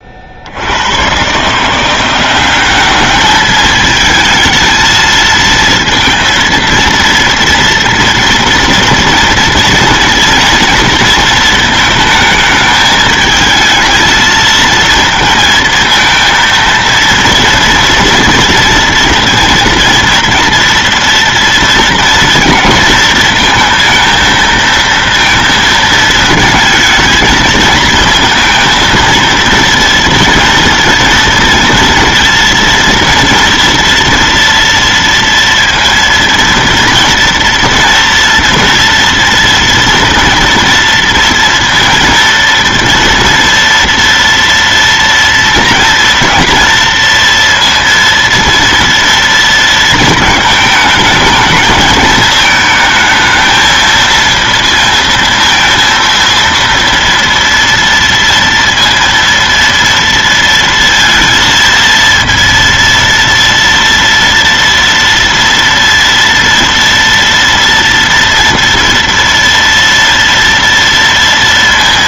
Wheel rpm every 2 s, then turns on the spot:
80, 200, 220, 230, 230, 230, 220, 220, 230, 230, 230, 230, 230, 220, 220, 230, 230, 230, 230, 230, 230, 230, 230, 230, 230, 220, 220, 230, 230, 230, 230, 230, 230, 230, 230, 230.
none